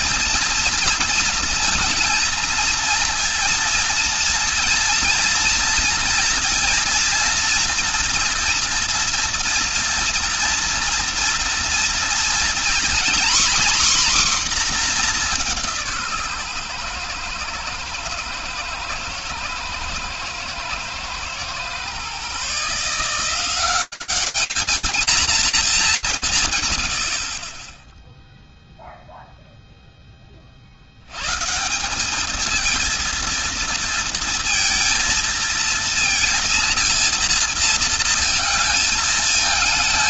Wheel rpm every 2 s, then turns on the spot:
230, 230, 230, 240, 240, 230, 240, 240, 130, 110, 110, 150, 210, 130, 0, 60, 220, 230, 230, 220.
none